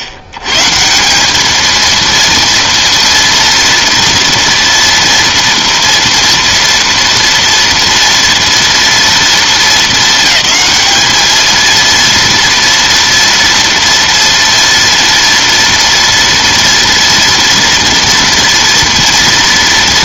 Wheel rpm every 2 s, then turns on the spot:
100, 230, 230, 230, 230, 210, 230, 230, 230, 230.
none